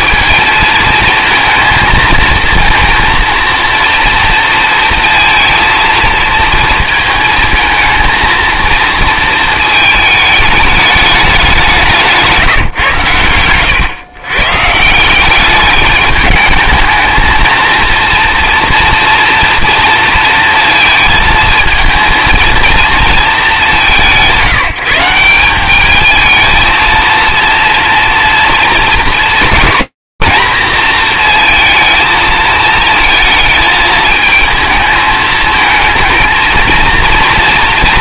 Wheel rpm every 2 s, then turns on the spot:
230, 230, 230, 230, 230, 210, 150, 140, 210, 240, 220, 230, 170, 230, 230, 230, 220, 220, 230.
none